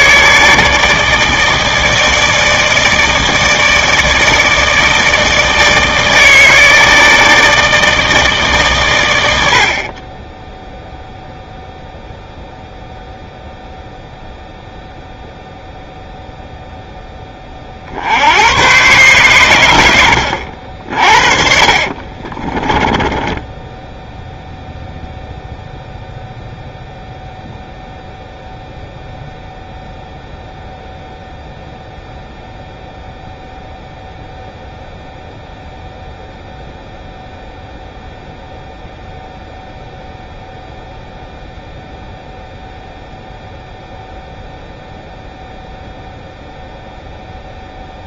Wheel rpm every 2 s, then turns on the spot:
150, 160, 160, 160, 110, 0, 0, 0, 10, 120, 50, 10, 0, 0, 0, 0, 0, 0, 0, 0, 0, 0, 0, 0.
22-24